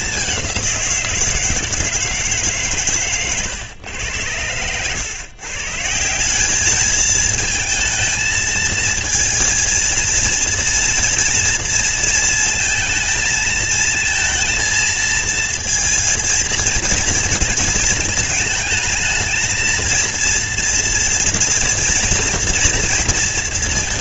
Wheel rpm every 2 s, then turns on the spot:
200, 150, 100, 180, 230, 230, 230, 230, 230, 220, 230, 240.
none